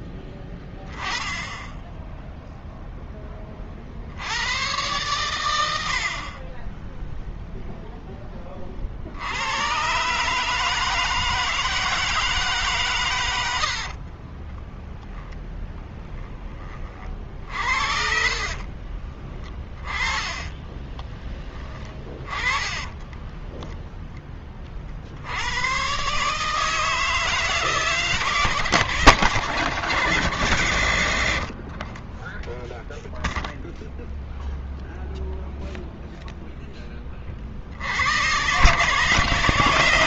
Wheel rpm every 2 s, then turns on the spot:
10, 10, 90, 40, 20, 150, 160, 50, 30, 60, 20, 20, 20, 140, 160, 150, 20, 0, 0, 100.
14-16 18-24 32-34